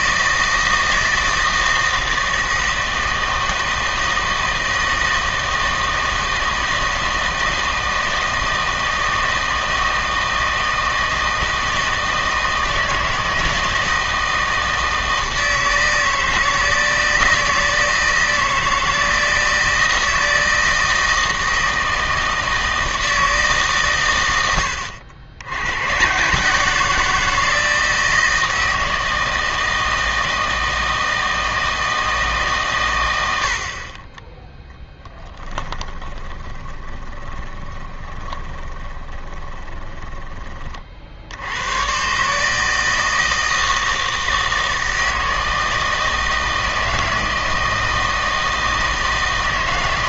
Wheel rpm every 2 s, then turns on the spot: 160, 160, 160, 160, 160, 160, 160, 160, 160, 160, 160, 160, 100, 160, 160, 160, 150, 10, 20, 20, 30, 150, 160, 160, 160.
36-40